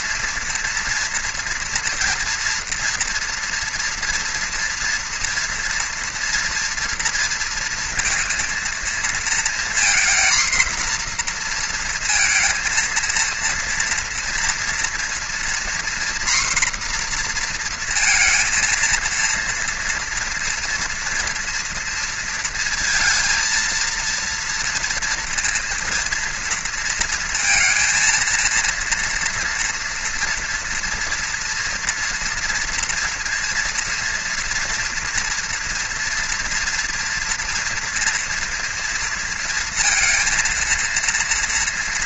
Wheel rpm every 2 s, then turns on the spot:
230, 230, 230, 230, 230, 240, 230, 230, 240, 230, 240, 230, 230, 230, 230, 230, 230, 230, 230, 230, 230.
none